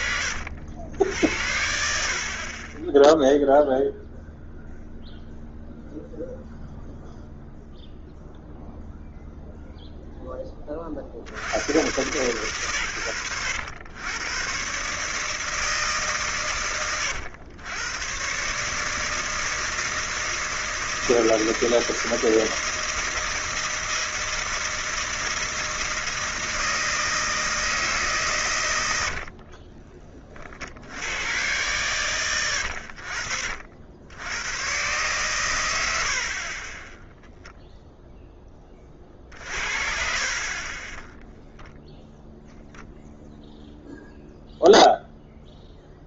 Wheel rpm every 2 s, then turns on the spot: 60, 30, 0, 0, 0, 10, 120, 120, 120, 150, 160, 160, 160, 160, 120, 60, 90, 120, 20, 30, 30, 0, 0.
2-4